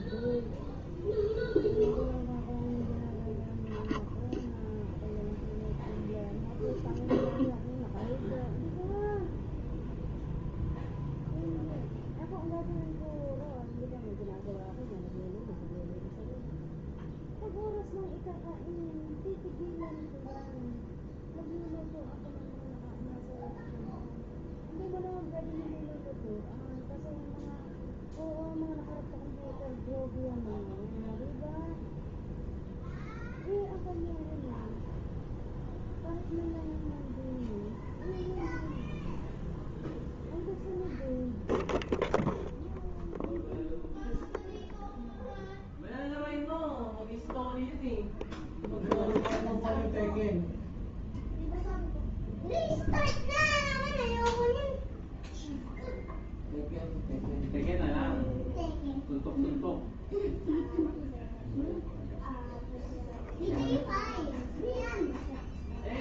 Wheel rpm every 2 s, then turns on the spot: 0, 0, 0, 0, 0, 0, 0, 0, 0, 0, 0, 0, 0, 0, 0, 0, 0, 0, 0, 0, 0, 0, 0, 0, 0, 0, 0, 0, 0, 0, 0, 0, 0.
none